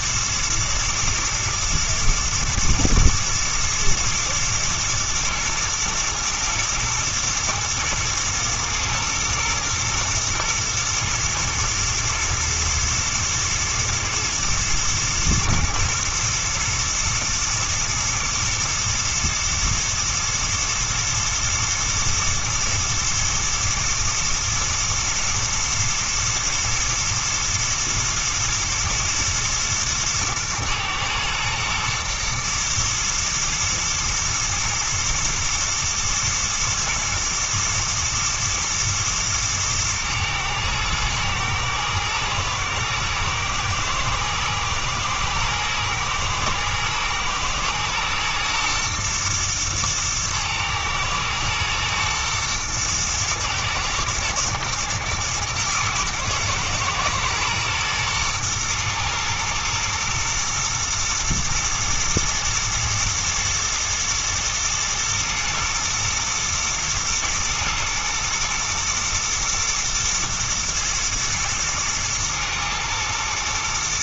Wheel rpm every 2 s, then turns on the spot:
120, 120, 120, 110, 110, 120, 120, 120, 110, 120, 110, 110, 110, 110, 110, 110, 110, 110, 120, 110, 110, 110, 120, 110, 120, 110, 110, 110, 120, 120, 120, 120, 120, 110, 110, 120, 120.
none